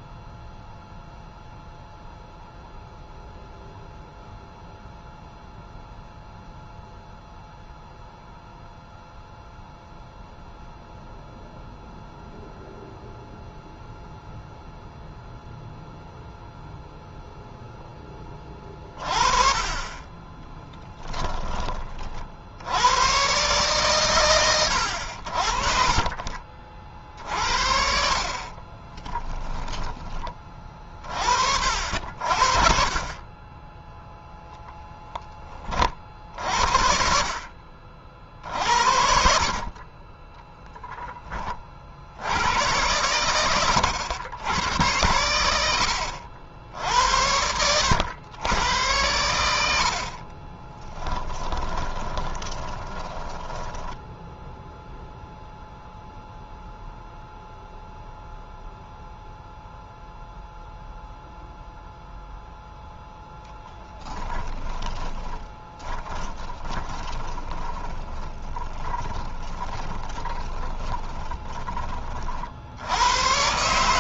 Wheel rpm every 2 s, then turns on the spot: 0, 0, 0, 0, 0, 0, 0, 0, 0, 30, 10, 100, 80, 50, 30, 30, 40, 10, 60, 50, 10, 100, 100, 80, 110, 30, 20, 0, 0, 0, 0, 0, 20, 20, 20, 20, 80.
20-22 28-30 50-54 64-72